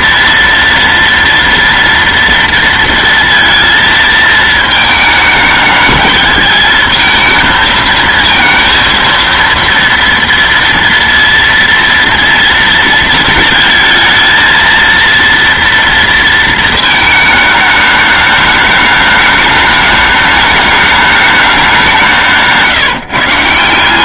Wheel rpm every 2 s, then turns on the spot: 230, 230, 220, 220, 230, 230, 230, 230, 230, 210, 210, 170.
22-24